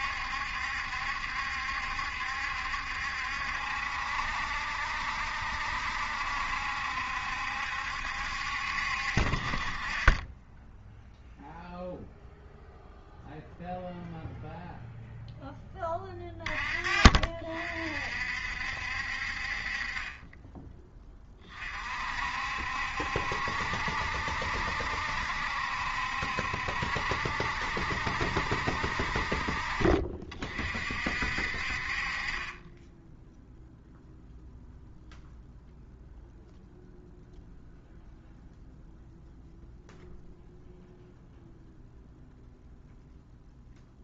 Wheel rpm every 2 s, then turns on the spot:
70, 70, 70, 70, 70, 10, 0, 0, 30, 60, 20, 60, 70, 70, 60, 40, 20, 0, 0, 0, 0, 0.
none